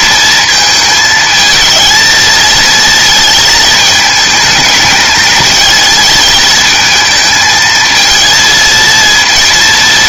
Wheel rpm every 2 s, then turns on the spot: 220, 230, 210, 220, 220.
none